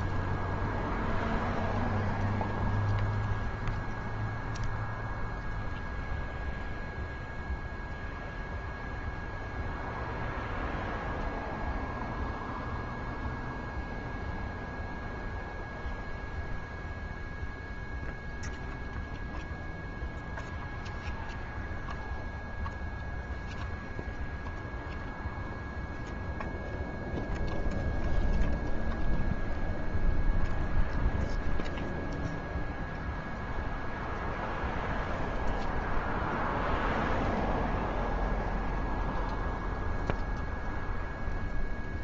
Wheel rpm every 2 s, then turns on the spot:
0, 0, 0, 0, 0, 0, 0, 0, 0, 0, 0, 0, 0, 0, 0, 0, 0, 0, 0, 0, 0.
none